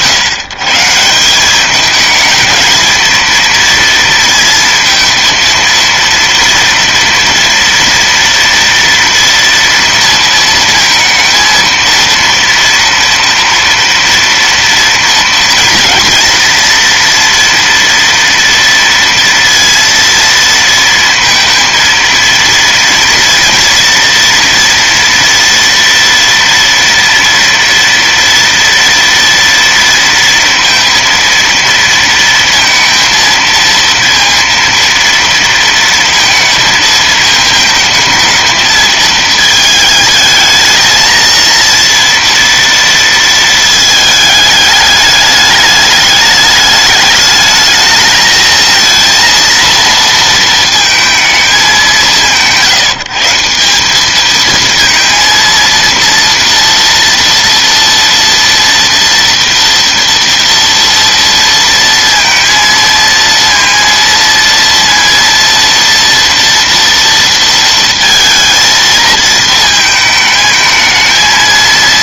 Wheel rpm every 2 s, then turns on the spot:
140, 230, 230, 230, 230, 220, 230, 230, 230, 230, 230, 230, 230, 230, 230, 230, 230, 230, 230, 220, 220, 230, 210, 210, 230, 230, 130, 220, 230, 230, 230, 230, 230, 230, 220, 220.
none